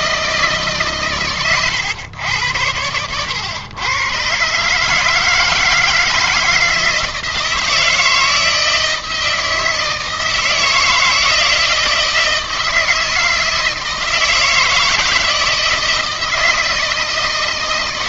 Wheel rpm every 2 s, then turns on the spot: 140, 100, 150, 160, 160, 160, 160, 160, 160.
none